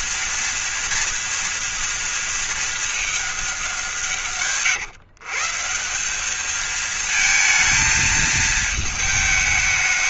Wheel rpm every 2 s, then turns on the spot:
230, 220, 150, 220, 220.
none